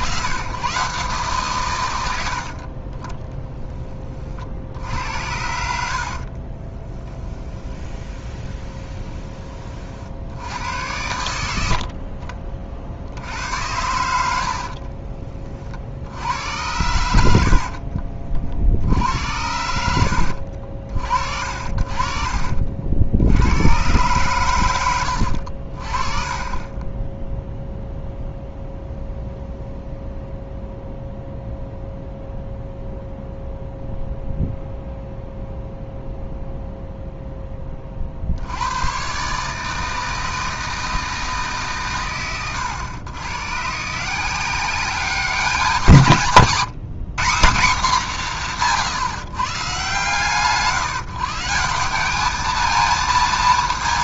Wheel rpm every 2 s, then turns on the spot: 130, 40, 60, 20, 20, 90, 50, 60, 100, 50, 70, 50, 110, 20, 0, 0, 0, 0, 0, 90, 160, 120, 180, 170, 160, 150, 220.
6-10 14-16 24-26